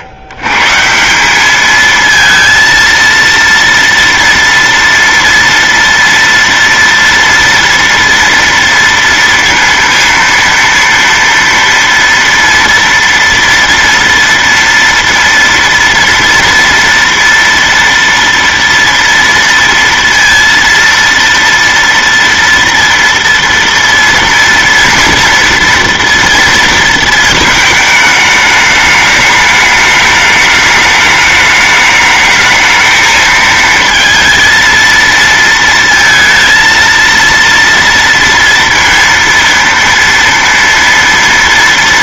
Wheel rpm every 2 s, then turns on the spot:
110, 230, 230, 230, 230, 230, 230, 230, 230, 230, 230, 230, 230, 230, 210, 210, 220, 230, 230, 230, 230.
none